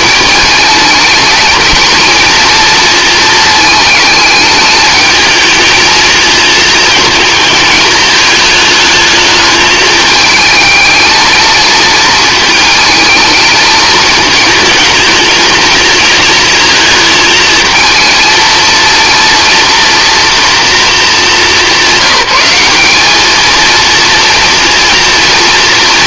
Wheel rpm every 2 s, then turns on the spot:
220, 230, 210, 220, 210, 220, 220, 220, 220, 230, 230, 210, 230.
none